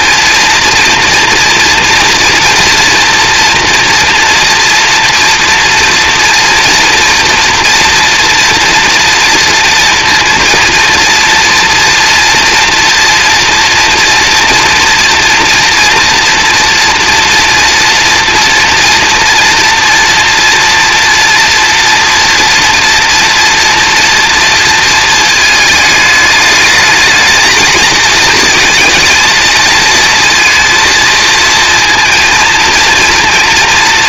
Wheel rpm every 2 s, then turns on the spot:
230, 230, 230, 230, 230, 230, 240, 230, 240, 230, 240, 230, 230, 210, 220, 230, 230.
none